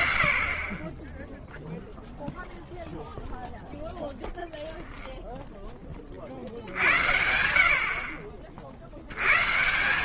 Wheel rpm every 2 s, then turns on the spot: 10, 0, 0, 80, 120.
none